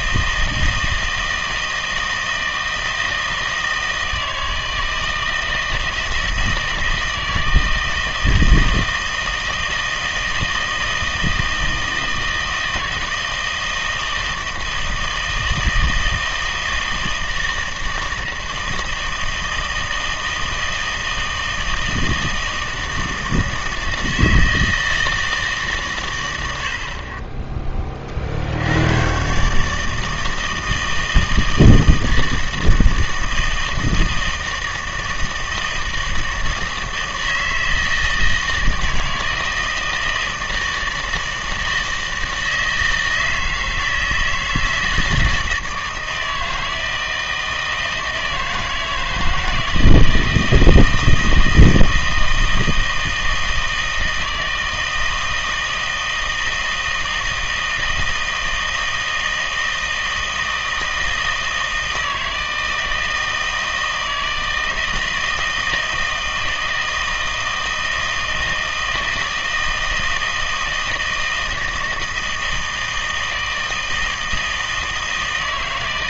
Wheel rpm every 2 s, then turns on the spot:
160, 160, 160, 160, 160, 160, 160, 160, 160, 160, 160, 160, 160, 70, 80, 160, 160, 160, 160, 160, 160, 160, 160, 160, 160, 160, 160, 160, 160, 160, 160, 160, 160, 160, 160, 160, 160, 160.
none